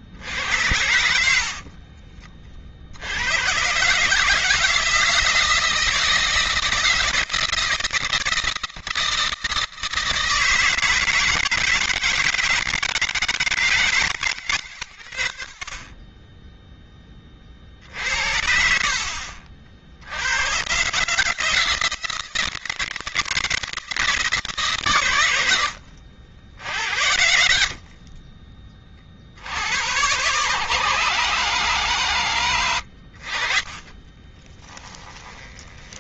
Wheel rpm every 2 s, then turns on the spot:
80, 50, 160, 160, 160, 160, 160, 130, 20, 70, 130, 160, 130, 80, 40, 130, 80, 10.
0-2 32-36